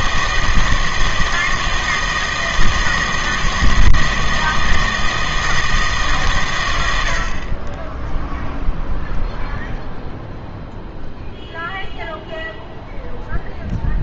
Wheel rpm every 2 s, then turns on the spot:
160, 160, 160, 110, 0, 0, 0.
none